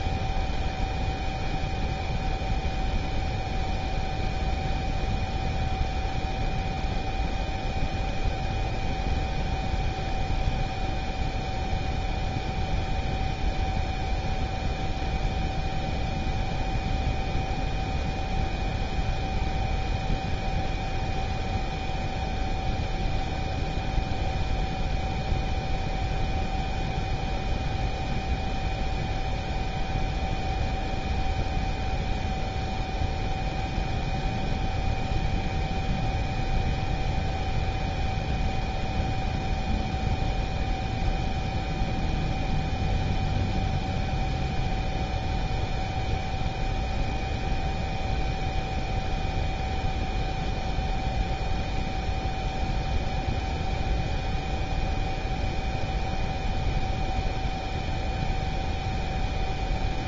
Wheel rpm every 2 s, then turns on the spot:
0, 0, 0, 0, 0, 0, 0, 0, 0, 0, 0, 0, 0, 0, 0, 0, 0, 0, 0, 0, 0, 0, 0, 0, 0, 0, 0, 0, 0, 0.
none